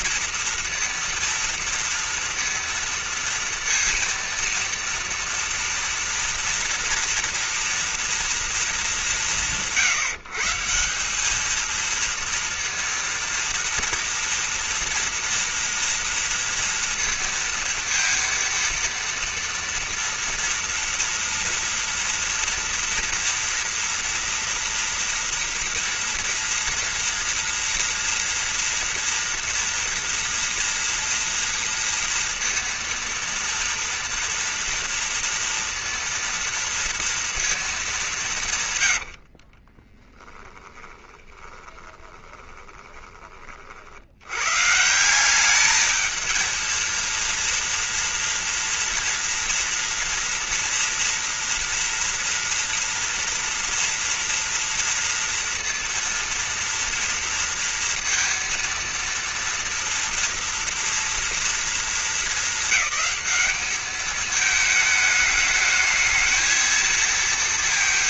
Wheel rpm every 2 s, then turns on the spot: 230, 230, 230, 230, 230, 160, 230, 230, 230, 230, 230, 230, 230, 230, 240, 230, 230, 230, 230, 160, 10, 20, 120, 230, 230, 230, 230, 230, 230, 230, 230, 220, 220, 220.
40-44